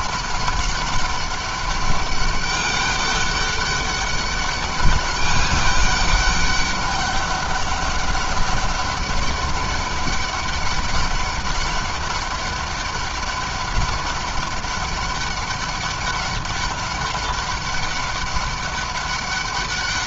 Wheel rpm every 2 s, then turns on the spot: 200, 200, 200, 200, 200, 200, 200, 200, 200, 200.
none